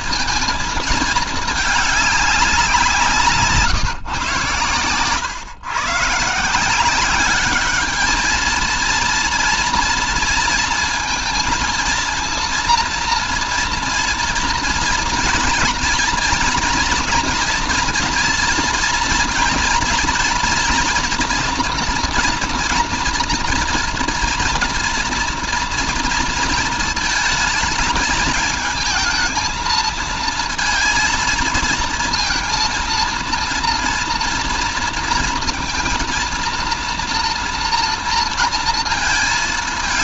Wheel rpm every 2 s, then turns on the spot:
220, 170, 120, 190, 230, 230, 230, 230, 230, 230, 230, 230, 230, 220, 220, 230, 230, 230, 230, 220.
none